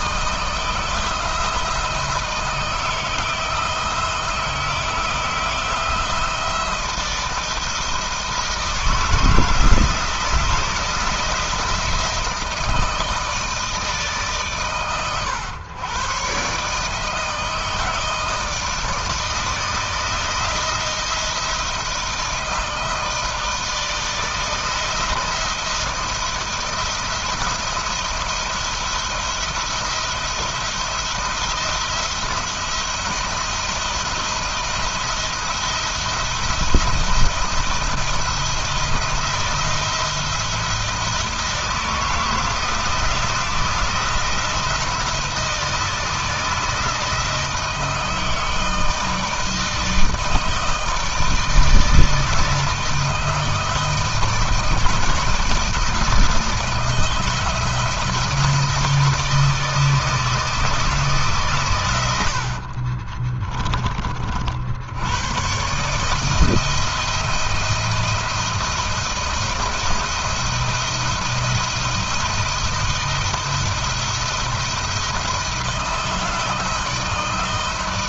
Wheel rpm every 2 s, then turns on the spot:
160, 160, 170, 160, 160, 160, 160, 120, 160, 160, 160, 160, 170, 160, 170, 170, 170, 170, 160, 170, 160, 160, 160, 160, 160, 160, 160, 160, 160, 160, 150, 30, 90, 170, 170, 170, 170, 170, 160.
62-64